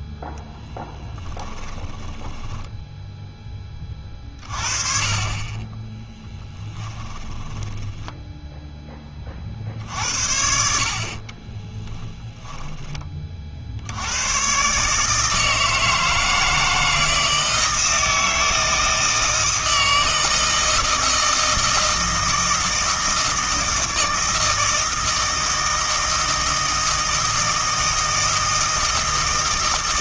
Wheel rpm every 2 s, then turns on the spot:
10, 10, 30, 10, 10, 70, 20, 140, 160, 160, 160, 160, 160, 160, 160.
0-4 6-8 12-14